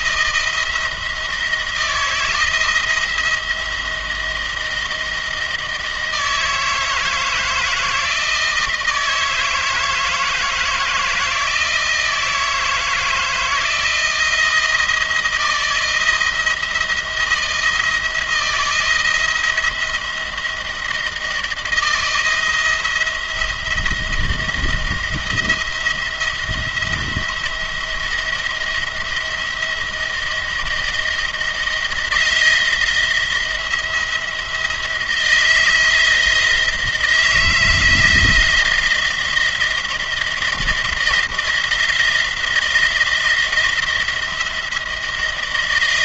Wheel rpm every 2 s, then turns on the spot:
160, 170, 170, 160, 160, 160, 160, 170, 170, 170, 170, 170, 170, 170, 170, 160, 160, 170, 170, 160, 170, 170, 170.
none